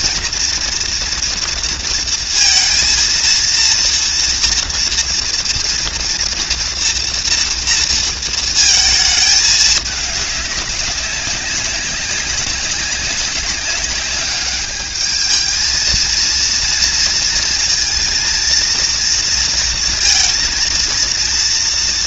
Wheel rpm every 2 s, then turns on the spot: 230, 230, 230, 240, 220, 200, 190, 210, 230, 230, 230.
none